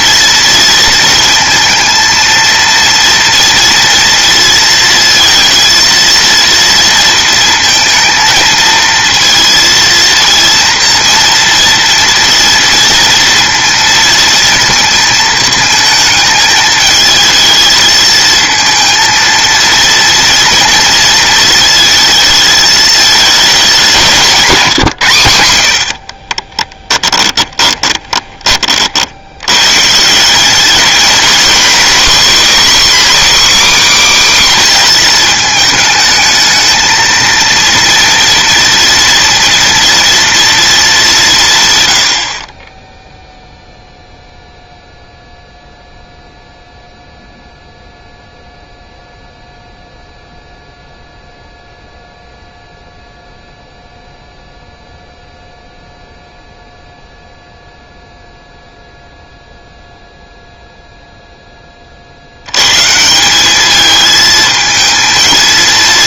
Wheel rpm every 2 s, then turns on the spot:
230, 230, 230, 230, 230, 240, 230, 220, 220, 230, 230, 220, 130, 10, 50, 220, 270, 250, 220, 230, 200, 10, 0, 0, 0, 0, 0, 0, 0, 0, 0, 140, 220.
24-28